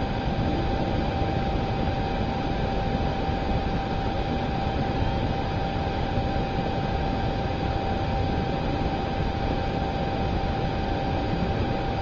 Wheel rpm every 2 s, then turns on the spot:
0, 0, 0, 0, 0, 0.
none